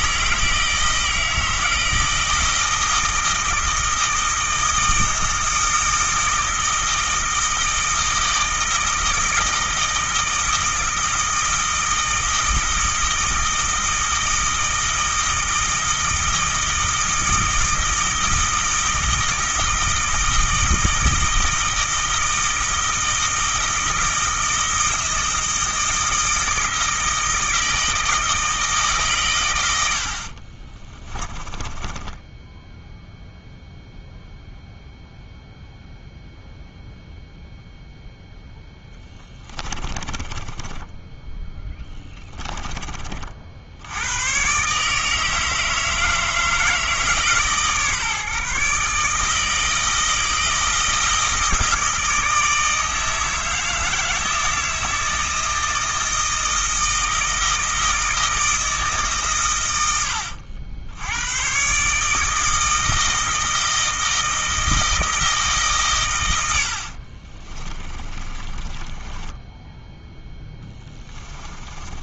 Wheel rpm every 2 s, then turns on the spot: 160, 160, 160, 160, 160, 160, 160, 160, 160, 160, 160, 160, 160, 160, 150, 30, 0, 0, 0, 10, 10, 30, 140, 160, 150, 160, 160, 160, 160, 160, 80, 160, 160, 70, 20, 20.
30-32 38-42 66-72